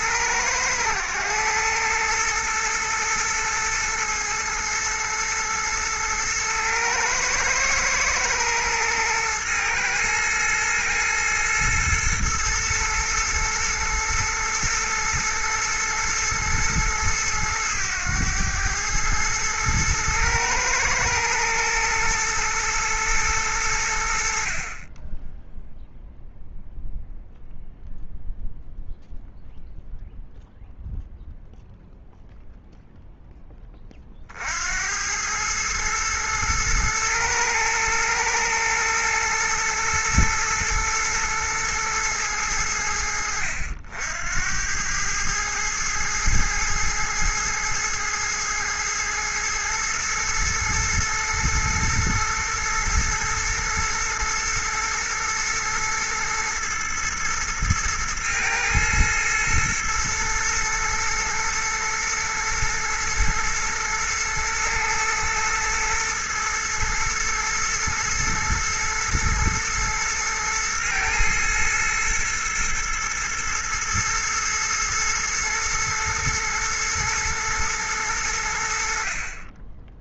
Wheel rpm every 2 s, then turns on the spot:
110, 110, 110, 110, 110, 110, 120, 120, 110, 110, 110, 110, 40, 0, 0, 0, 0, 70, 110, 110, 120, 80, 90, 110, 110, 110, 120, 120, 120, 110, 110, 120, 110, 110, 110, 110, 120, 110, 110, 80.
none